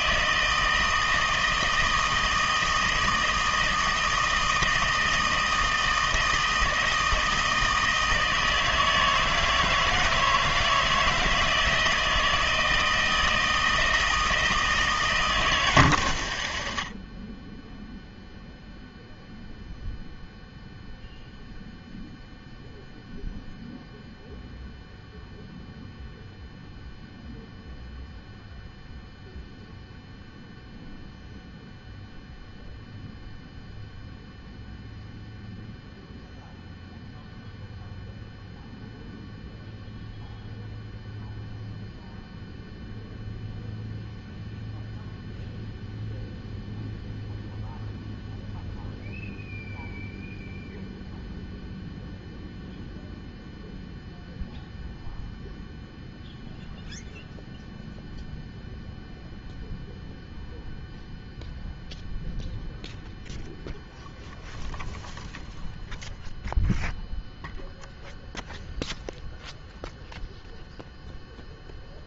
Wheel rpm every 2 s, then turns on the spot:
160, 160, 160, 160, 160, 160, 160, 160, 70, 0, 0, 0, 0, 0, 0, 0, 0, 0, 0, 0, 0, 0, 0, 0, 0, 0, 0, 0, 0, 0, 0, 0, 0, 0, 0, 0.
none